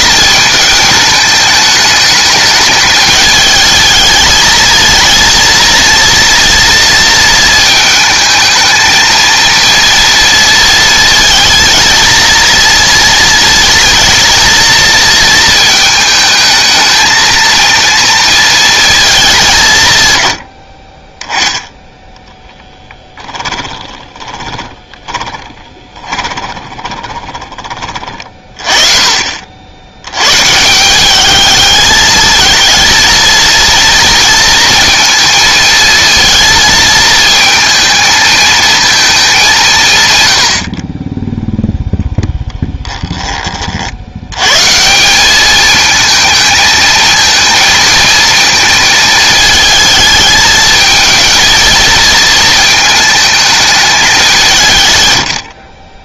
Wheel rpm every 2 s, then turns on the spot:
220, 220, 220, 230, 220, 230, 230, 230, 220, 220, 50, 10, 20, 20, 30, 150, 220, 230, 230, 220, 60, 0, 130, 220, 220, 220, 220, 160.
22-28